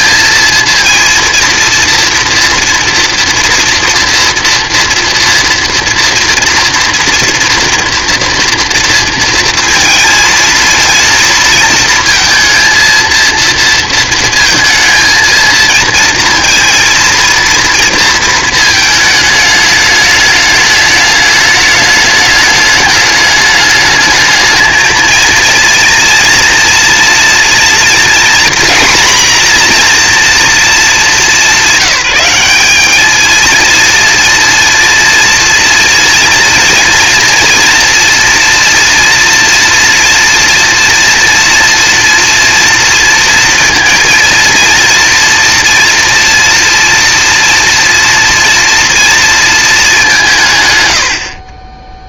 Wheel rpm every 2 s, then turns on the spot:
230, 240, 230, 230, 230, 230, 230, 230, 230, 220, 210, 210, 220, 230, 240, 200, 220, 230, 230, 230, 230, 230, 230, 230, 230, 50.
none